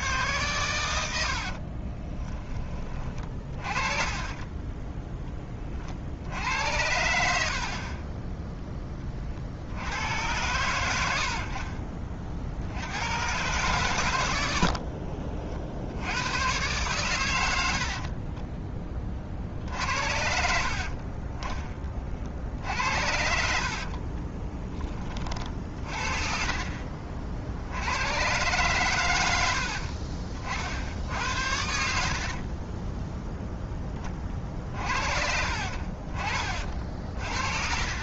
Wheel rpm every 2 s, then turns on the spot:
110, 30, 20, 90, 10, 100, 80, 70, 120, 20, 50, 60, 20, 40, 120, 60, 20, 50, 40.
14-16 26-28